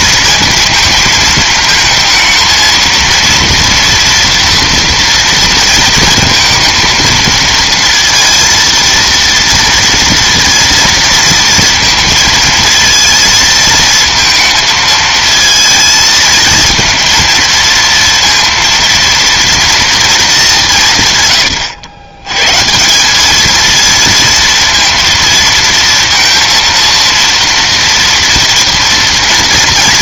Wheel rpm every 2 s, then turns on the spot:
220, 230, 230, 230, 230, 230, 230, 230, 230, 230, 130, 220, 230, 230, 230.
none